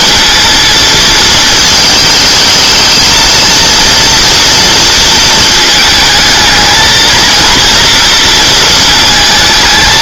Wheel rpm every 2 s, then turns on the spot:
230, 220, 230, 220, 230.
none